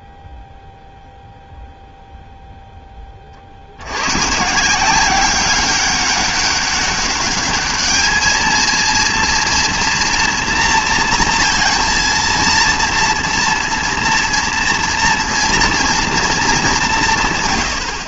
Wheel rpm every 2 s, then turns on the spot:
0, 10, 160, 200, 220, 240, 230, 230, 200.
none